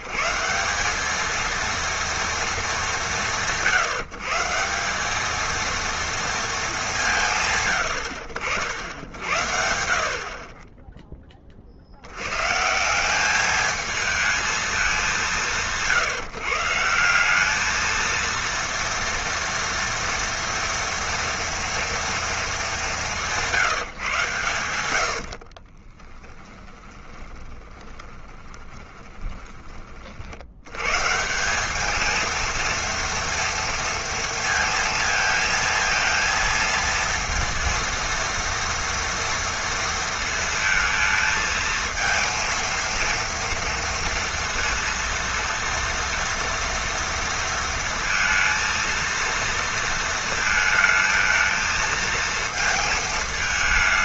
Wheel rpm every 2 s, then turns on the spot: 180, 220, 160, 210, 80, 20, 150, 220, 160, 230, 230, 210, 100, 20, 20, 100, 230, 230, 230, 230, 220, 230, 230, 230, 230, 220, 230.
26-30